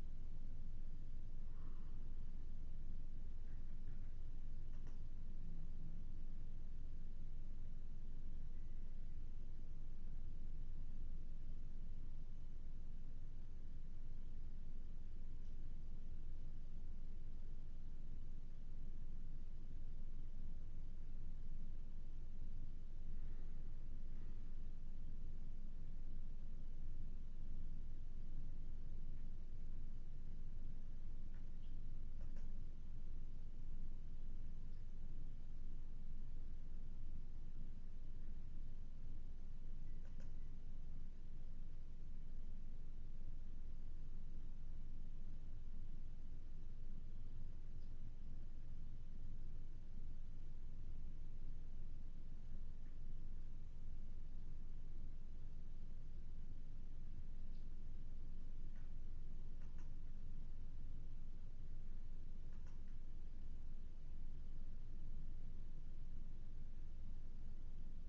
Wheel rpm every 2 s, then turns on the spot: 0, 0, 0, 0, 0, 0, 0, 0, 0, 0, 0, 0, 0, 0, 0, 0, 0, 0, 0, 0, 0, 0, 0, 0, 0, 0, 0, 0, 0, 0, 0, 0, 0, 0.
none